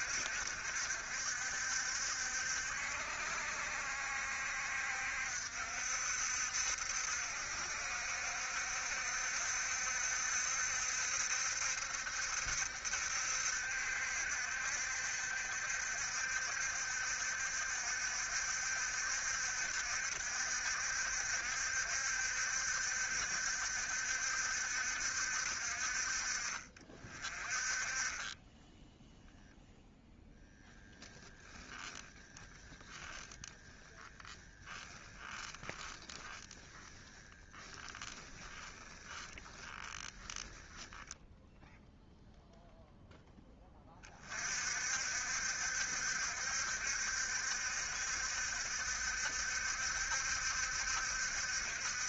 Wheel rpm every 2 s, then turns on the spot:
60, 70, 60, 60, 70, 70, 70, 70, 70, 70, 70, 60, 60, 40, 0, 0, 10, 10, 10, 10, 10, 0, 60, 70, 70, 70.
32-42